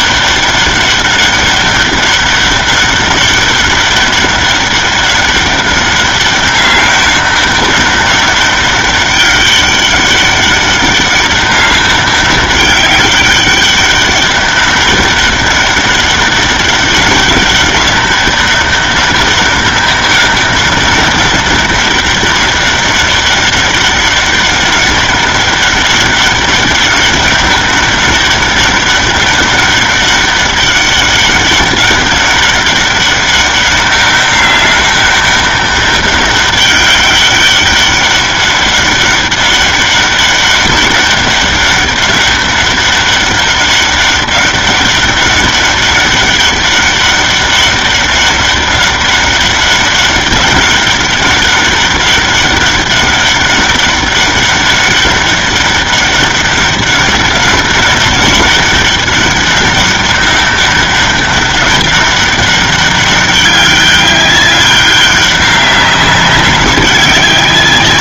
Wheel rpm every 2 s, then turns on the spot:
200, 200, 200, 200, 200, 200, 190, 200, 190, 200, 200, 200, 200, 200, 200, 200, 200, 200, 200, 200, 200, 200, 200, 200, 200, 200, 200, 200, 200, 200, 190, 200, 200, 190.
none